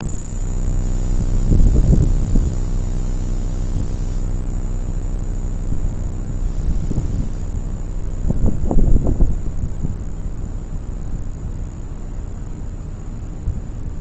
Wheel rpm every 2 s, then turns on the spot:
0, 0, 0, 0, 0, 0, 0.
none